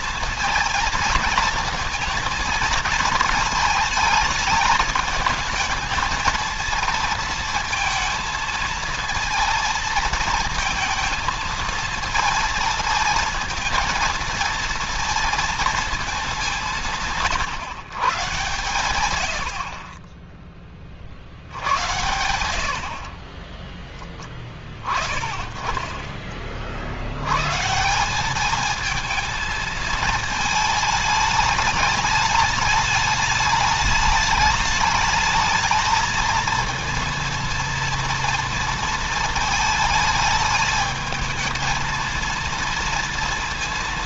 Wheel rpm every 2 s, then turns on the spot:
230, 230, 210, 230, 230, 230, 230, 230, 160, 110, 30, 50, 20, 60, 220, 220, 210, 210, 230, 230, 220, 230.
none